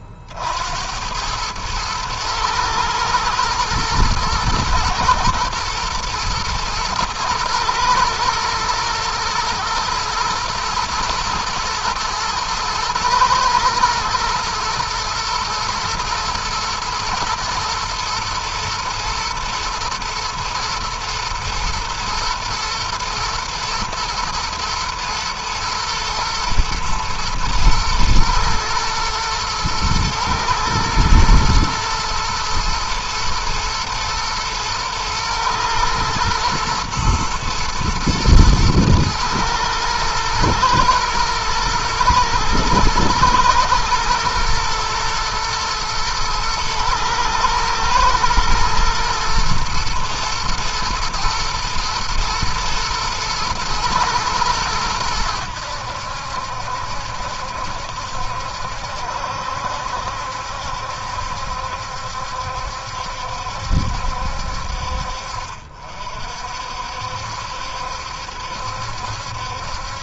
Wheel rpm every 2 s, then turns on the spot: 70, 110, 110, 110, 110, 120, 120, 120, 120, 110, 120, 110, 120, 110, 110, 110, 120, 110, 110, 110, 110, 120, 120, 110, 120, 120, 120, 110, 70, 70, 70, 70, 60, 60, 70.
none